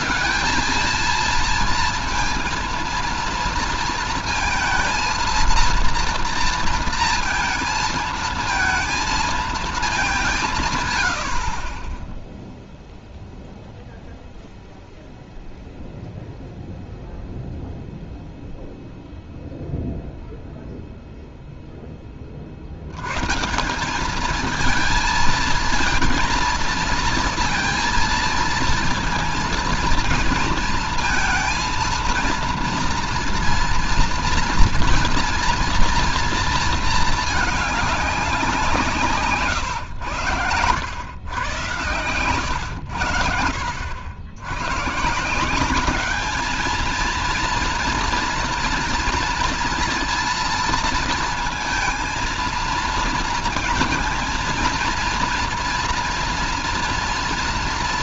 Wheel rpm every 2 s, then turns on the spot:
220, 230, 230, 230, 230, 170, 0, 0, 0, 0, 0, 50, 220, 230, 230, 230, 230, 230, 230, 190, 110, 100, 100, 220, 240, 230, 230, 230, 230.
40-42